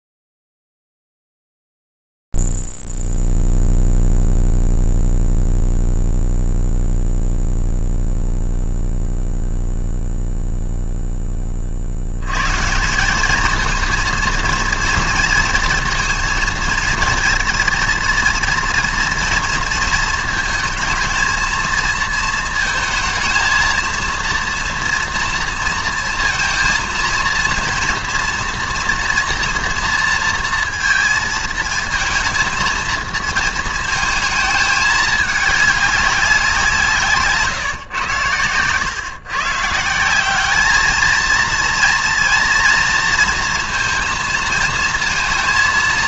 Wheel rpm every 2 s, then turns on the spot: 0, 0, 0, 0, 0, 0, 80, 230, 230, 230, 220, 220, 230, 230, 230, 230, 230, 220, 190, 120, 190, 230, 230.
none